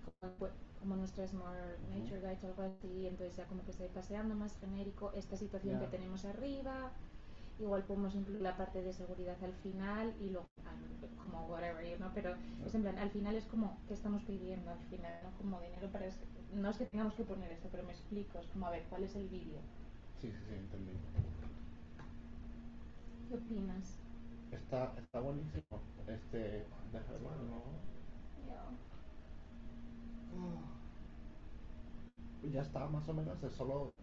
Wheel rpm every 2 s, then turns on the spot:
0, 0, 0, 0, 0, 0, 0, 0, 0, 0, 0, 0, 0, 0, 0, 0, 0.
none